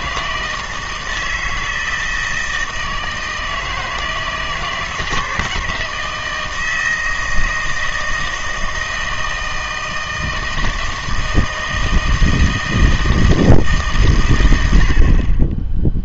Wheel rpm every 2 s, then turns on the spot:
160, 160, 170, 160, 160, 160, 160, 80.
none